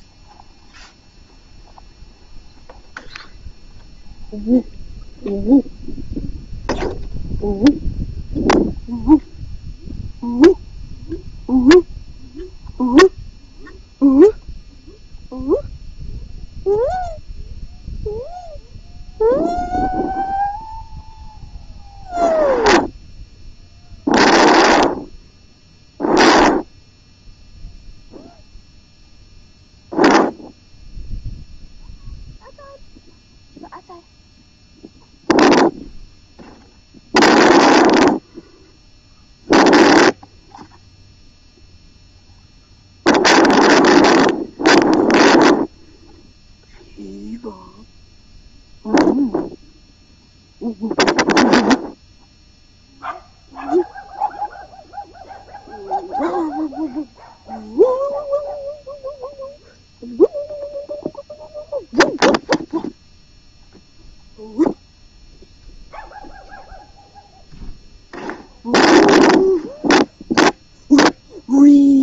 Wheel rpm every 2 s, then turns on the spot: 0, 0, 0, 0, 0, 0, 0, 0, 0, 0, 0, 0, 0, 0, 0, 0, 0, 0, 0, 0, 0, 0, 0, 0, 0, 0, 0, 0, 0, 0, 0, 0, 0, 0, 0, 0.
none